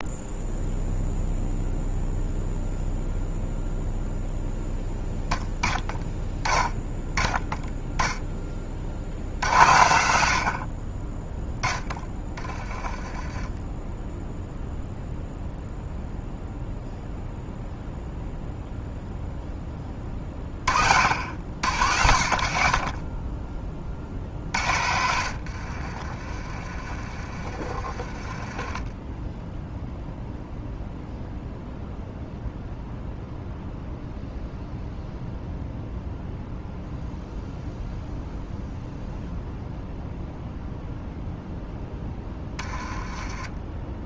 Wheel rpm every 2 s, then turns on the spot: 0, 0, 0, 10, 70, 20, 20, 0, 0, 0, 70, 20, 80, 40, 10, 0, 0, 0, 0, 0, 0, 20.
12-14 24-28